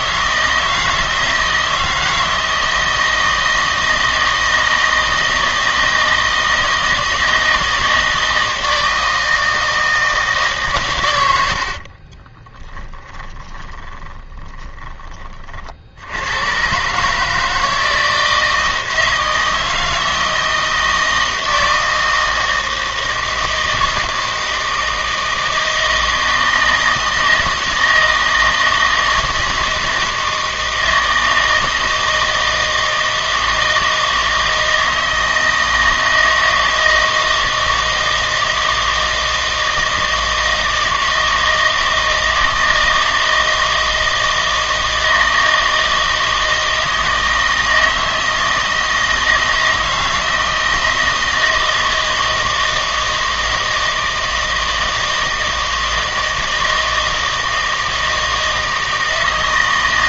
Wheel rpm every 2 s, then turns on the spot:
160, 160, 160, 160, 160, 140, 30, 20, 130, 160, 160, 160, 160, 160, 160, 160, 160, 160, 160, 160, 160, 160, 160, 160, 160, 160, 160, 160, 160, 160.
12-14